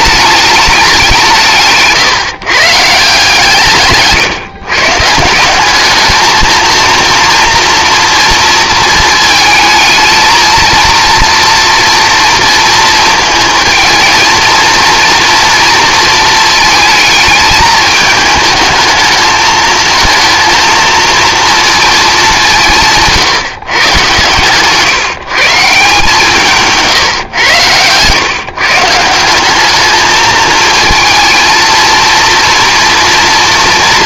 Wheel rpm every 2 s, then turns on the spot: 200, 150, 150, 230, 230, 230, 220, 230, 220, 220, 230, 160, 150, 150, 160, 230, 240.
26-28